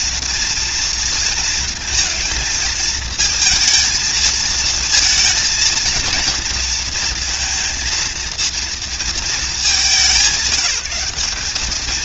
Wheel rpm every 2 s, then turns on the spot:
230, 230, 230, 230, 230, 190.
none